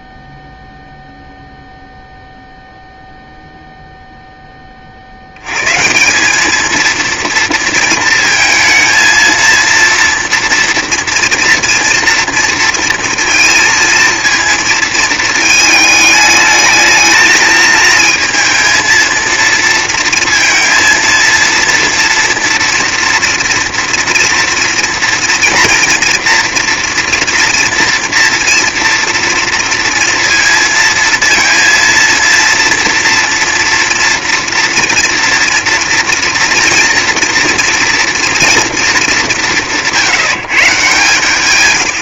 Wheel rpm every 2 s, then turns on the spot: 0, 0, 20, 210, 220, 230, 230, 230, 220, 230, 230, 230, 230, 230, 230, 230, 230, 240, 230, 230, 170.
none